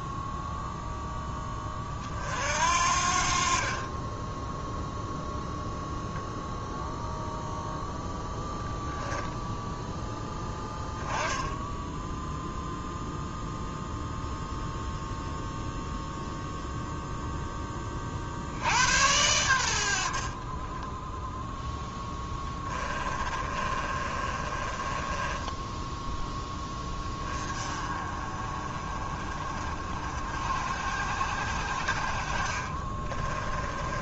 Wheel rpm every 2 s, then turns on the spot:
0, 60, 0, 0, 0, 10, 0, 0, 0, 80, 20, 20, 30, 10, 40, 60, 30.
20-26 32-34